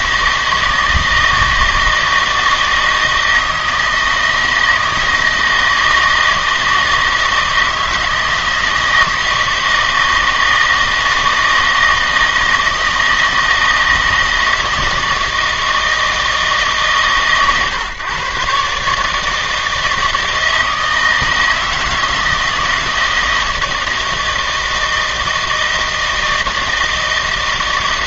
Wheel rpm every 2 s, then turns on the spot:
160, 160, 160, 160, 160, 160, 160, 160, 150, 140, 160, 160, 160, 160.
none